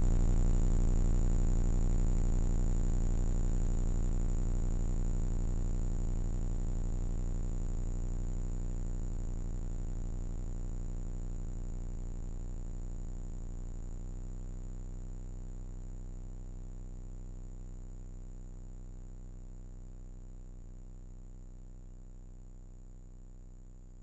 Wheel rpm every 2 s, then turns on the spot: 40, 10, 120, 160, 150, 0, 0, 0, 0, 0, 0, 0.
none